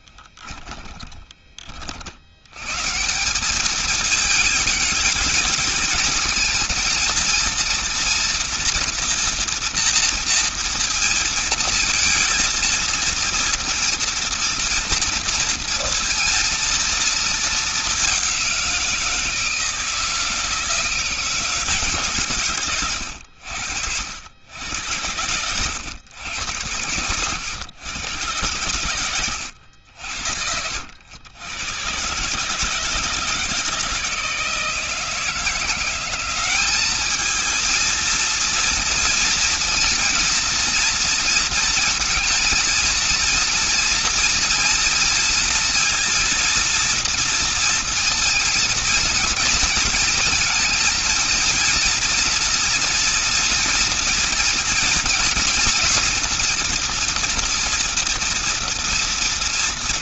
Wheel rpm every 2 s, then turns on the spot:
10, 80, 220, 220, 230, 230, 230, 230, 230, 200, 160, 140, 80, 100, 110, 70, 130, 160, 190, 230, 230, 230, 230, 230, 230, 220, 240, 230, 230, 230.
0-2